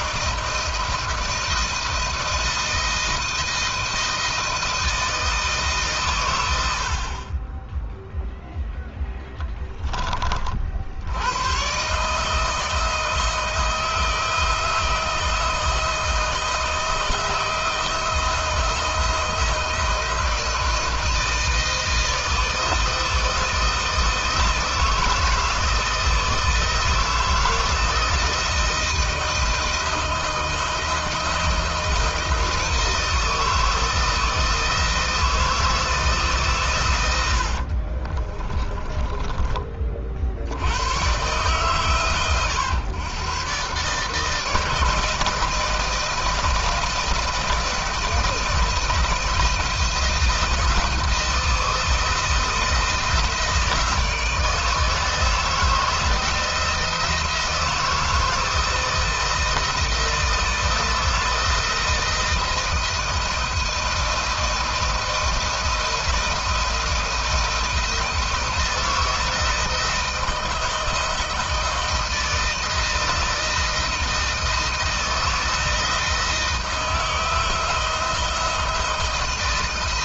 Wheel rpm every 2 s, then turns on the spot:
160, 160, 160, 70, 0, 60, 160, 170, 160, 170, 160, 160, 160, 160, 160, 160, 160, 160, 130, 20, 90, 130, 160, 160, 160, 160, 160, 160, 160, 160, 160, 160, 160, 170, 160, 160, 160, 160, 160, 160.
38-40